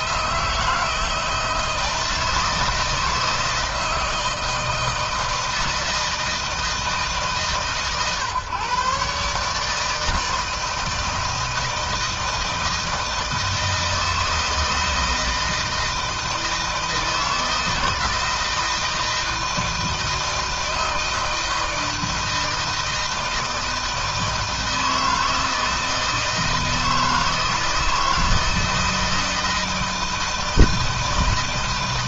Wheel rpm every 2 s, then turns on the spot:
160, 160, 160, 150, 140, 160, 160, 160, 160, 160, 160, 160, 160, 160, 160, 160.
none